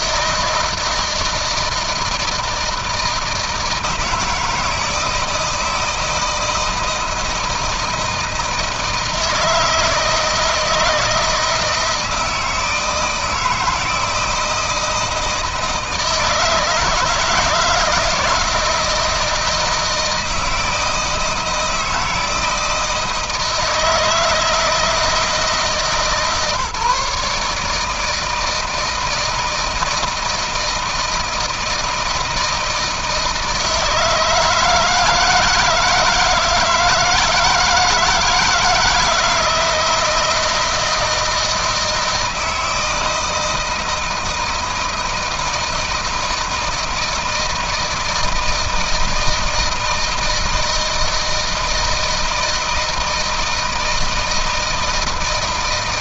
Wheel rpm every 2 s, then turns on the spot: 160, 160, 160, 160, 160, 160, 160, 160, 160, 160, 160, 160, 160, 150, 160, 160, 160, 160, 160, 170, 160, 160, 160, 160, 160, 160, 160, 160.
none